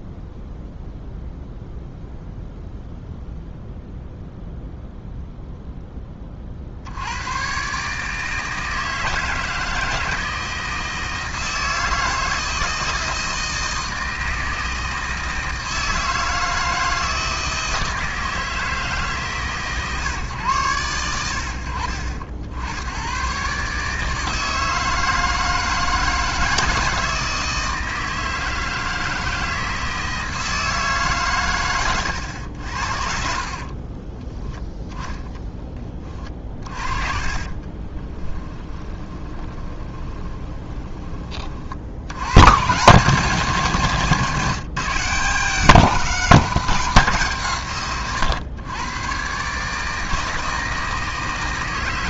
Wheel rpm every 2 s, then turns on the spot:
0, 0, 0, 50, 160, 160, 160, 160, 160, 160, 110, 80, 160, 160, 160, 160, 80, 10, 40, 20, 20, 130, 160, 190, 110, 160.
32-42